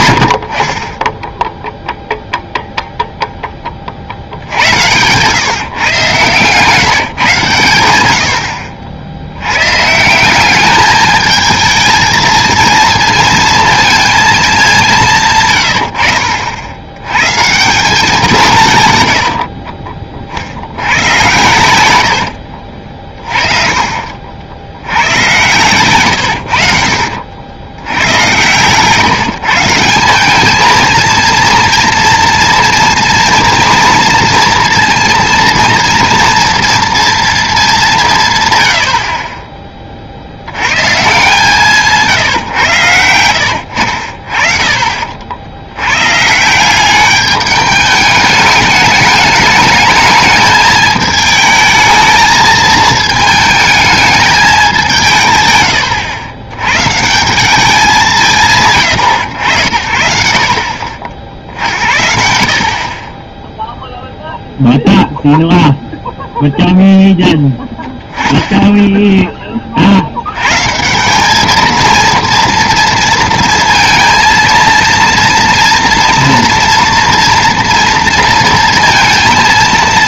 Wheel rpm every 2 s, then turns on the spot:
30, 0, 90, 140, 60, 210, 220, 190, 80, 150, 80, 60, 70, 70, 130, 220, 230, 230, 230, 90, 110, 110, 40, 170, 210, 210, 220, 200, 120, 130, 60, 40, 0, 0, 0, 140, 230, 230, 230, 230.
none